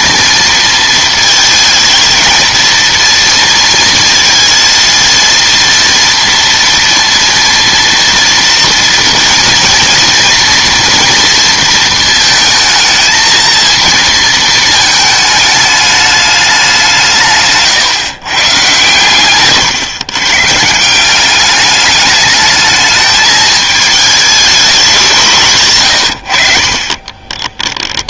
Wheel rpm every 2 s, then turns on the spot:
230, 230, 230, 230, 230, 230, 220, 220, 190, 130, 140, 220, 210, 50.
none